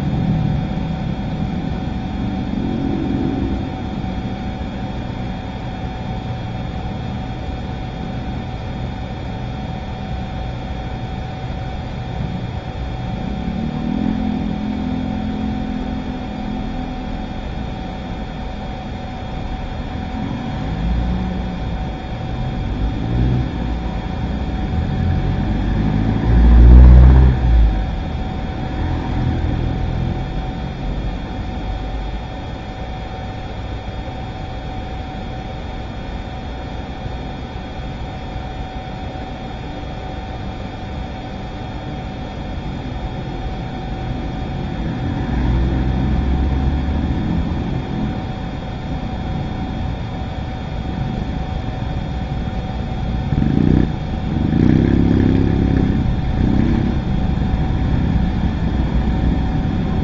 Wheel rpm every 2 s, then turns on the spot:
0, 0, 0, 0, 0, 0, 0, 0, 0, 0, 0, 0, 0, 0, 0, 0, 0, 0, 0, 0, 0, 0, 0, 0, 0, 0, 0, 0, 0, 0.
none